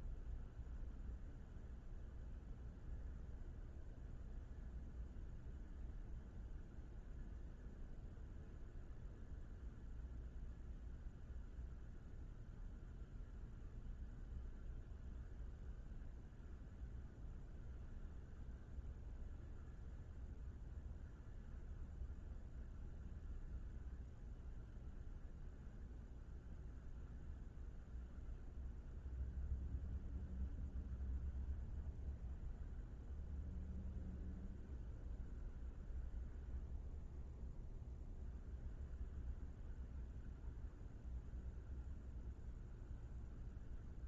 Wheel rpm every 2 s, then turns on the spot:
0, 0, 0, 0, 0, 0, 0, 0, 0, 0, 0, 0, 0, 0, 0, 0, 0, 0, 0, 0, 0, 0.
none